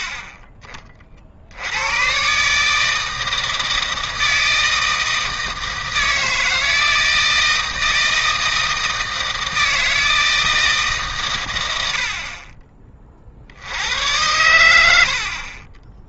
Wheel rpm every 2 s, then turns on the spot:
50, 150, 160, 160, 160, 160, 30, 90.
none